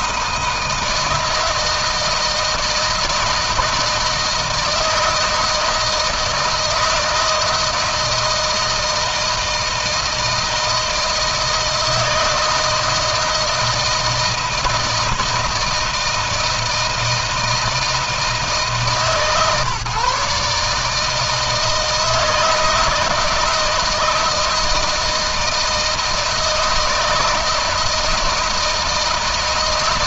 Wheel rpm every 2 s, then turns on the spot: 160, 160, 160, 160, 160, 160, 160, 160, 160, 140, 160, 160, 160, 160, 160.
none